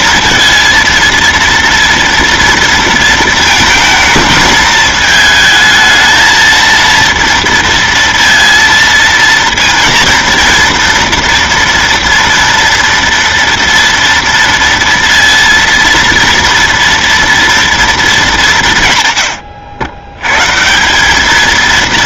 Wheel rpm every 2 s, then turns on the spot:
230, 230, 220, 230, 230, 230, 240, 230, 230, 180, 140.
none